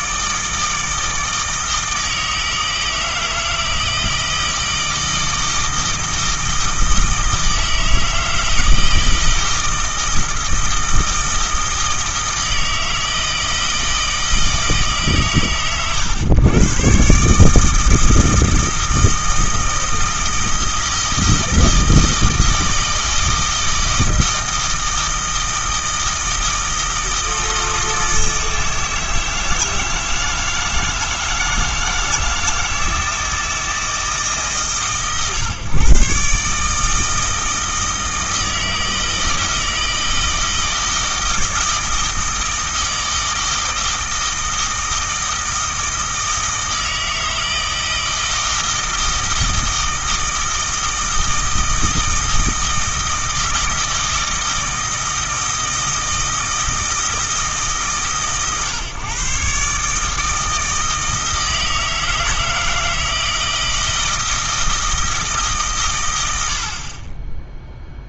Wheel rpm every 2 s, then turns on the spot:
160, 160, 160, 160, 160, 160, 160, 150, 120, 160, 160, 160, 160, 160, 160, 160, 160, 120, 160, 160, 160, 160, 160, 160, 160, 160, 160, 160, 160, 130, 160, 160, 160, 50.
none